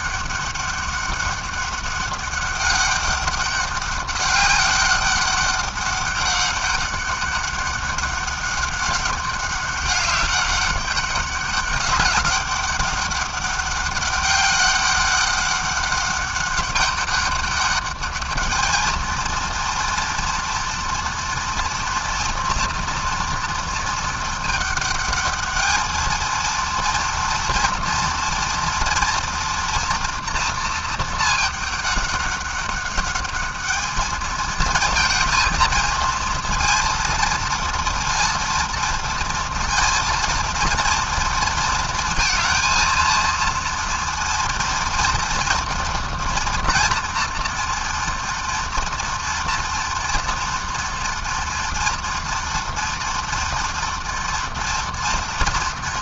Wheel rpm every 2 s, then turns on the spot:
200, 200, 200, 200, 200, 200, 200, 200, 200, 230, 230, 230, 220, 230, 230, 220, 200, 230, 230, 230, 230, 230, 230, 230, 230, 230, 230, 230.
none